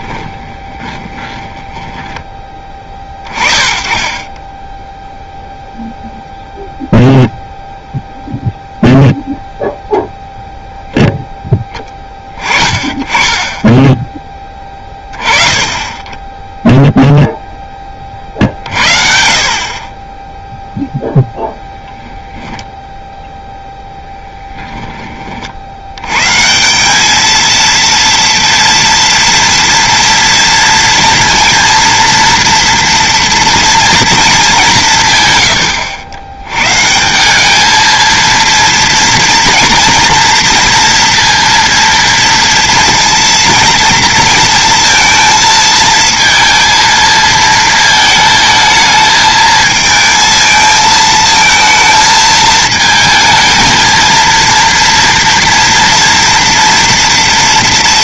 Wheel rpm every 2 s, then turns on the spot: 20, 20, 10, 0, 0, 0, 20, 20, 0, 50, 0, 10, 10, 170, 230, 230, 240, 190, 120, 230, 230, 230, 230, 230, 220, 220, 220, 230, 230.
0-2 24-26